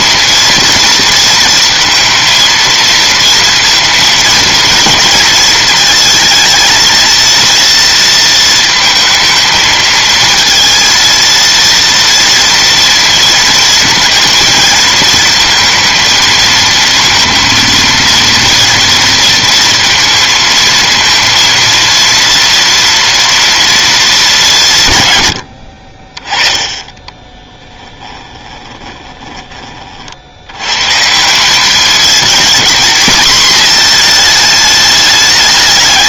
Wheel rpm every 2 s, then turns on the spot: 230, 230, 220, 230, 230, 230, 230, 230, 220, 230, 230, 230, 190, 20, 10, 90, 220, 220.
26-30